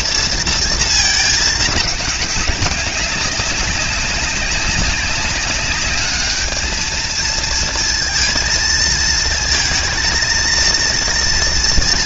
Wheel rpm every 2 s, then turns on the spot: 230, 200, 190, 220, 230, 230.
none